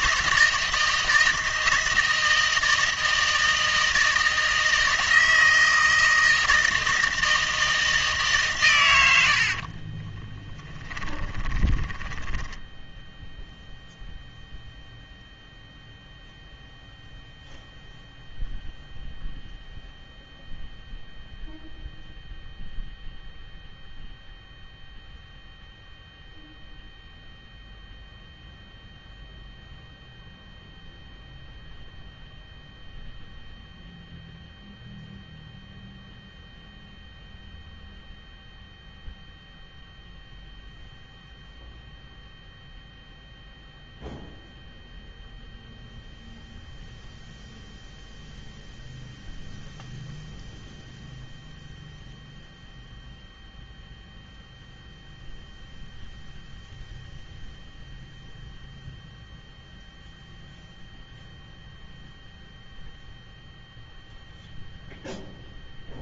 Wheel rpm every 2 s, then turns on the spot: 160, 160, 160, 160, 120, 20, 10, 0, 0, 0, 0, 0, 0, 0, 0, 0, 0, 0, 0, 0, 0, 0, 0, 0, 0, 0, 0, 0, 0, 0, 0, 0, 0.
10-12